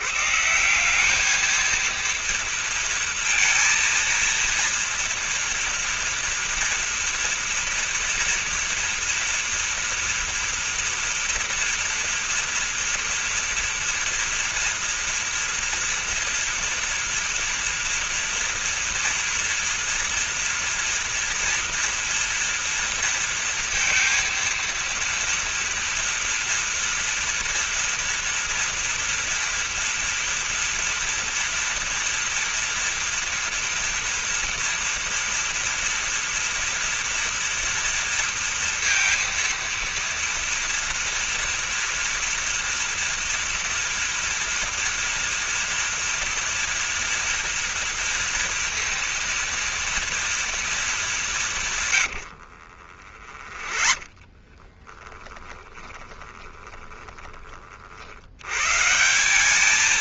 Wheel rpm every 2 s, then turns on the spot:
140, 230, 230, 230, 240, 230, 240, 240, 230, 230, 230, 230, 230, 230, 230, 230, 230, 230, 240, 230, 230, 240, 240, 230, 230, 230, 80, 20, 20, 90.
52-58